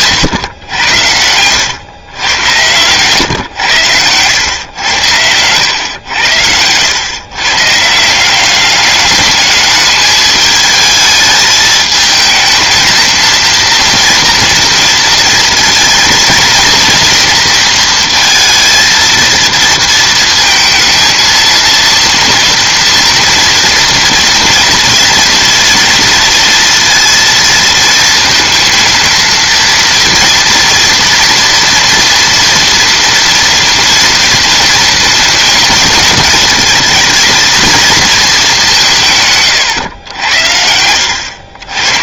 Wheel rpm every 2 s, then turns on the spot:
100, 120, 110, 100, 200, 210, 220, 230, 230, 230, 230, 230, 230, 230, 230, 230, 230, 230, 230, 190, 90.
0-2